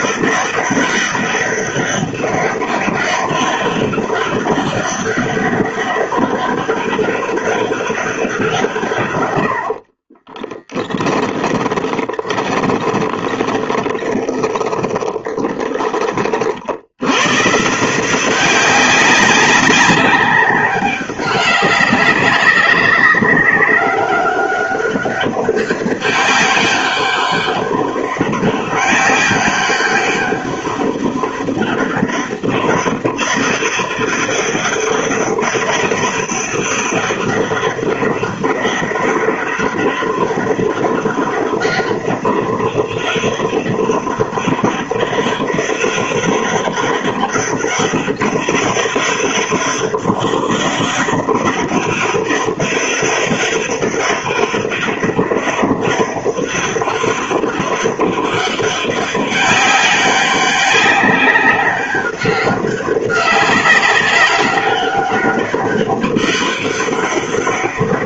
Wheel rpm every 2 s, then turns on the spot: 200, 200, 200, 200, 170, 20, 30, 20, 50, 190, 200, 190, 190, 200, 200, 200, 200, 200, 200, 200, 200, 200, 190, 200, 200, 200, 200, 200, 200, 200, 190, 190, 200, 200.
10-16